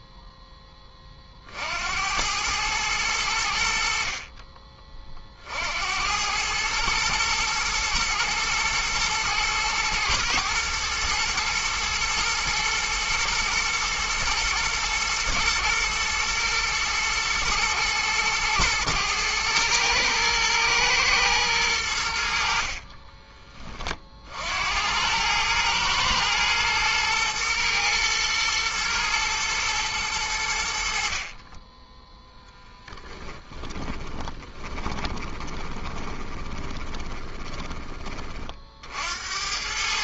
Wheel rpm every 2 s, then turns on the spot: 20, 100, 30, 110, 110, 110, 110, 120, 120, 110, 120, 40, 90, 120, 110, 60, 10, 20, 20, 50.
22-24 32-38